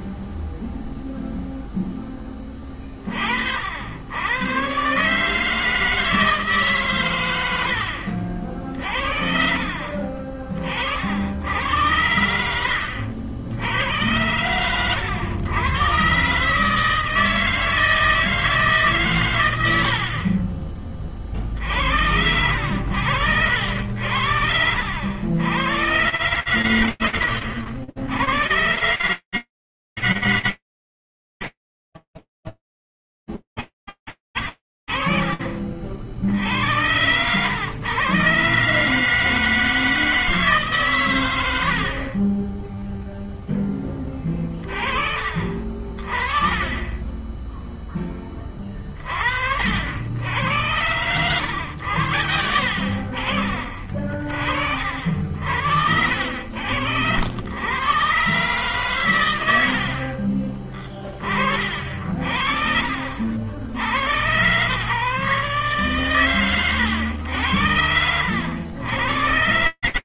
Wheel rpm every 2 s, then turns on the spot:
0, 10, 80, 160, 60, 40, 90, 90, 130, 160, 60, 80, 70, 100, 100, 120, 10, 30, 90, 150, 120, 0, 30, 10, 50, 100, 60, 60, 100, 90, 30, 60, 140, 80, 90.
24-26